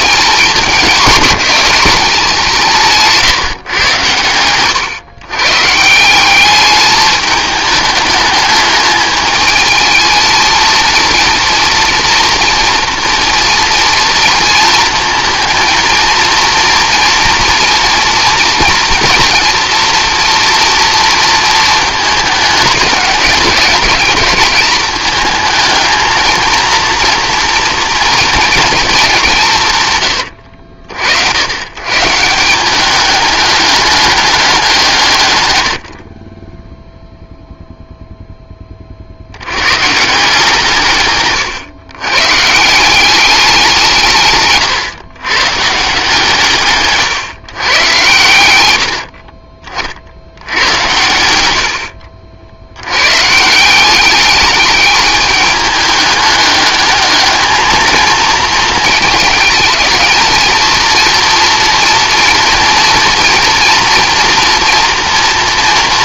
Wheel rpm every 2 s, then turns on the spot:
210, 170, 120, 210, 210, 230, 230, 230, 240, 230, 230, 210, 210, 230, 210, 70, 200, 180, 0, 30, 150, 170, 130, 140, 70, 100, 90, 210, 210, 220, 230, 240, 230.
46-48